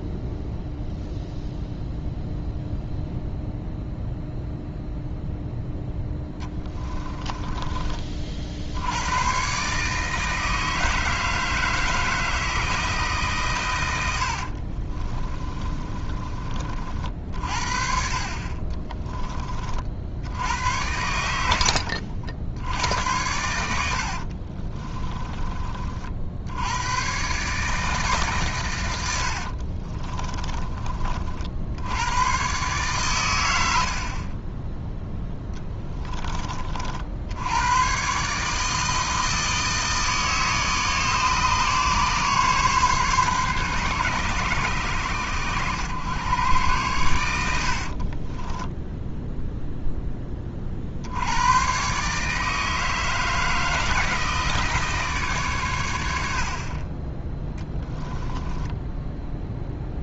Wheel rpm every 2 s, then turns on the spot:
0, 0, 0, 20, 90, 160, 160, 50, 50, 20, 80, 80, 30, 100, 100, 30, 130, 10, 60, 160, 150, 140, 120, 110, 10, 50, 160, 150, 30, 10.
6-8 14-16 18-20 24-26 34-36 48-50